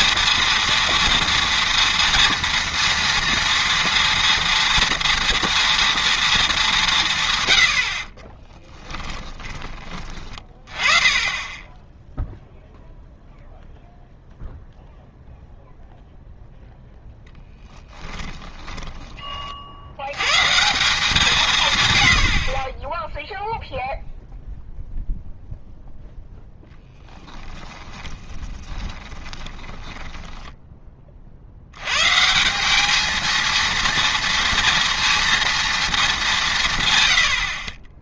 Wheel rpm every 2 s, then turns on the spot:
230, 230, 230, 210, 20, 30, 0, 0, 0, 10, 160, 40, 0, 10, 20, 10, 190, 240, 150.
8-10 18-20 26-30